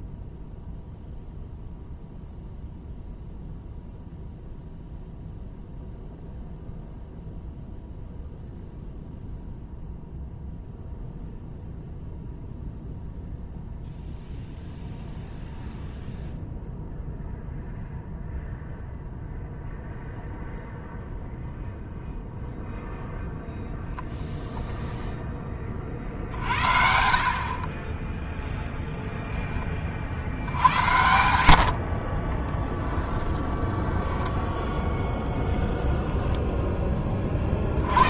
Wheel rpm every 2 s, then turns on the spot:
0, 0, 0, 0, 0, 0, 0, 0, 0, 0, 0, 0, 0, 60, 0, 90, 10, 0, 10.
32-34